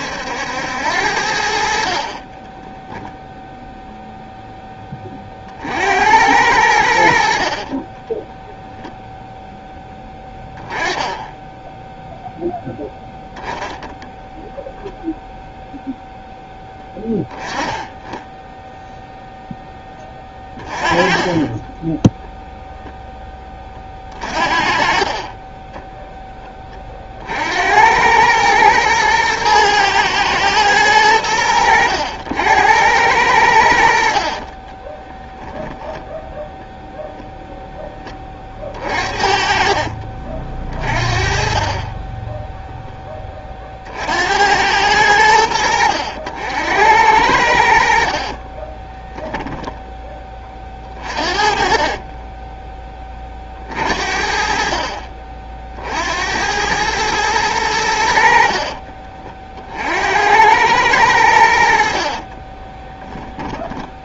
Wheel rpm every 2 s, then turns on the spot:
80, 10, 10, 90, 0, 10, 0, 0, 10, 0, 20, 10, 40, 20, 110, 110, 90, 20, 0, 40, 30, 0, 90, 80, 20, 30, 20, 50, 100, 40, 100, 20.
2-4 10-12 20-22 34-36 48-52 58-60 62-64